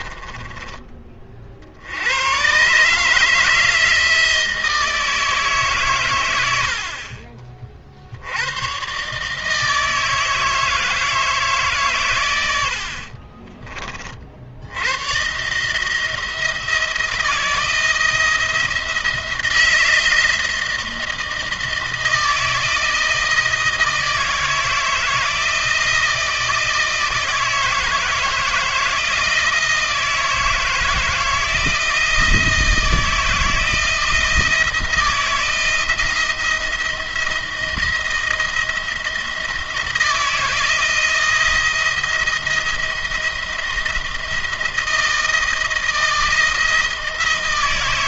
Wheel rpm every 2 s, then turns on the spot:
20, 130, 160, 80, 110, 160, 80, 70, 160, 160, 160, 170, 160, 160, 160, 160, 160, 170, 170, 170, 160, 170, 170, 160.
none